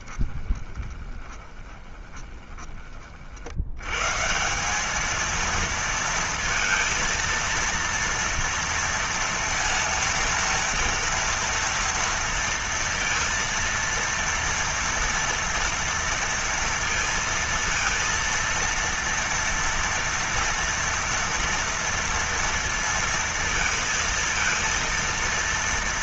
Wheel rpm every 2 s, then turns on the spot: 20, 20, 140, 230, 230, 230, 230, 230, 230, 230, 230, 230, 230.
0-4